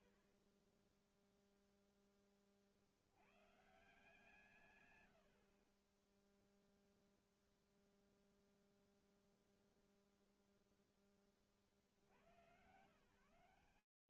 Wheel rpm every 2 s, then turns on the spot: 0, 150, 0, 0, 0, 80, 60.
none